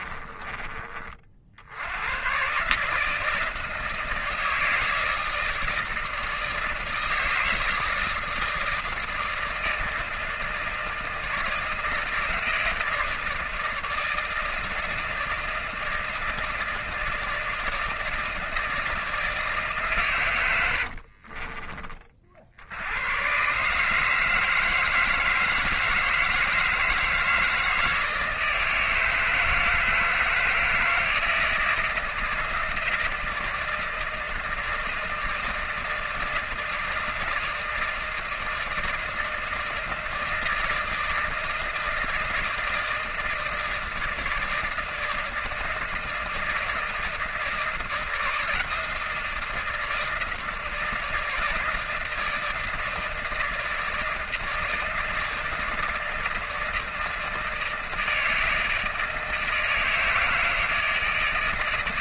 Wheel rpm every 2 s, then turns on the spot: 30, 150, 160, 160, 160, 160, 160, 160, 160, 160, 70, 110, 160, 160, 160, 160, 160, 160, 160, 160, 160, 160, 160, 160, 160, 160, 160, 160, 160, 160, 160.
20-22